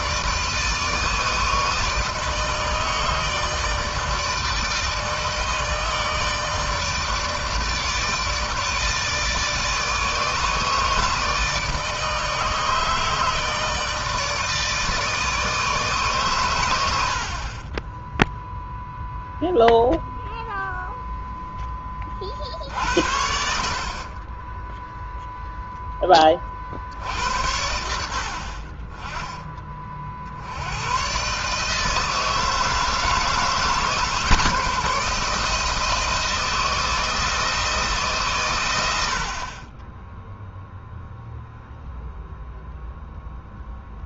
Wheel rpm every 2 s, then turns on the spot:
160, 160, 160, 160, 150, 150, 160, 150, 90, 0, 0, 60, 10, 50, 30, 90, 160, 160, 160, 90, 0, 0.
none